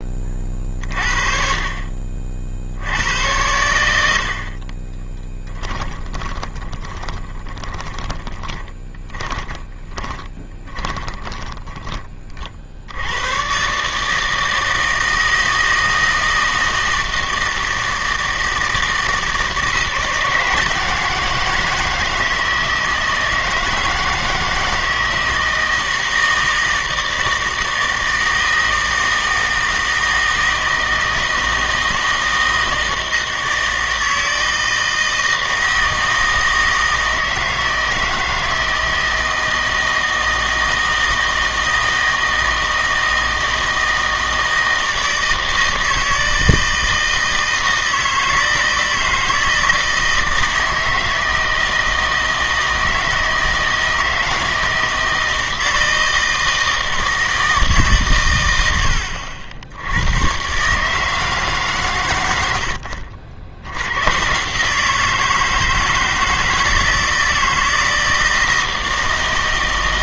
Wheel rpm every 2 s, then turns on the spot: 40, 70, 40, 20, 20, 20, 60, 160, 160, 160, 170, 160, 160, 160, 160, 160, 160, 160, 160, 160, 160, 160, 160, 160, 160, 160, 160, 160, 160, 100, 140, 80, 150, 160, 160.
6-12